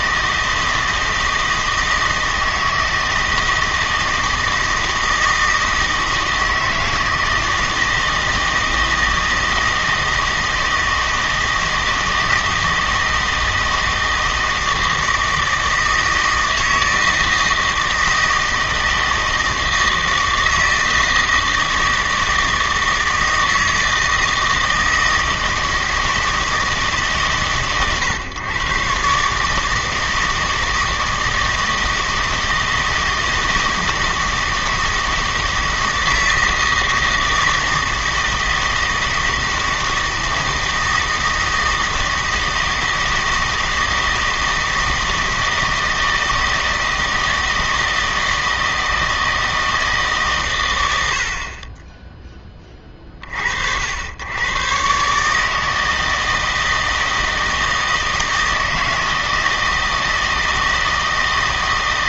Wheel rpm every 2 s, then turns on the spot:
160, 160, 160, 160, 160, 160, 160, 160, 160, 160, 160, 160, 160, 150, 120, 160, 160, 160, 160, 160, 160, 160, 160, 160, 160, 120, 20, 120, 160, 160, 160.
none